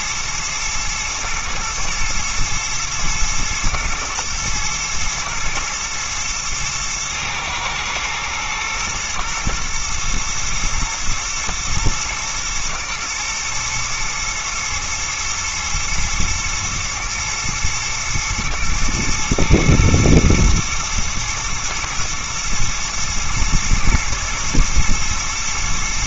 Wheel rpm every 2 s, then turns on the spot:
120, 120, 110, 110, 120, 110, 120, 120, 110, 110, 110, 120, 120.
none